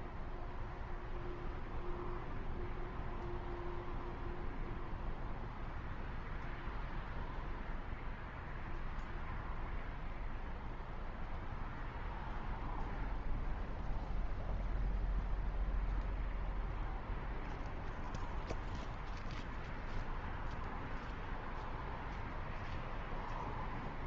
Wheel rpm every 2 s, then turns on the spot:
0, 0, 0, 0, 0, 0, 0, 0, 0, 0, 0, 0.
none